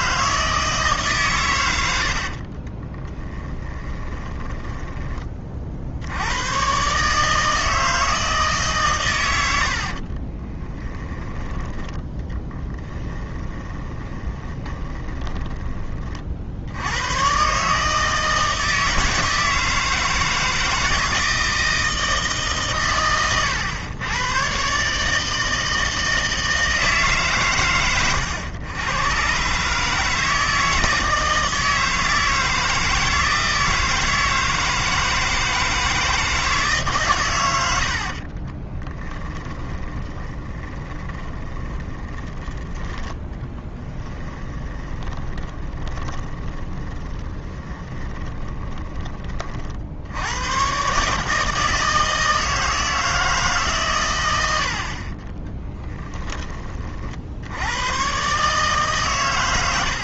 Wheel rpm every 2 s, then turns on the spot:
160, 40, 10, 120, 140, 10, 10, 20, 80, 160, 160, 130, 130, 160, 120, 160, 160, 160, 150, 30, 30, 10, 20, 20, 20, 120, 160, 60, 30, 140.
2-6 10-16 38-42 44-50